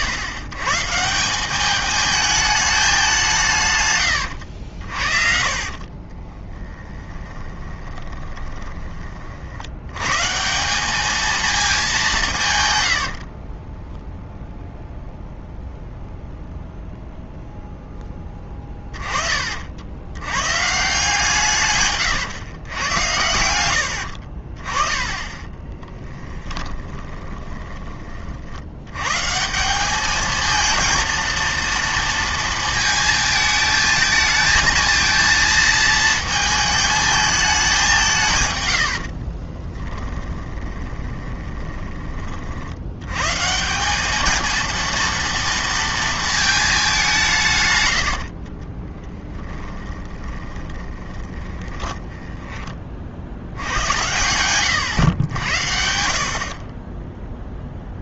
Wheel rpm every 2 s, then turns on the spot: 130, 210, 70, 10, 20, 190, 110, 0, 0, 20, 140, 110, 30, 10, 70, 220, 230, 220, 220, 100, 20, 70, 230, 210, 20, 30, 20, 100, 30.
4-10 18-20 26-28 38-42 48-52